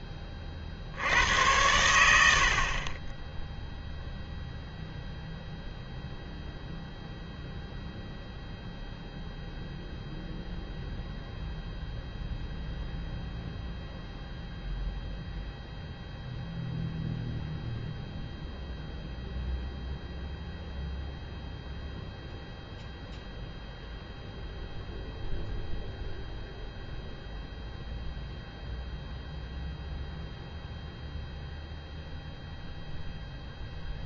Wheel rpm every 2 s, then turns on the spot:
50, 50, 0, 0, 0, 0, 0, 0, 0, 0, 0, 0, 0, 0, 0, 0, 0.
none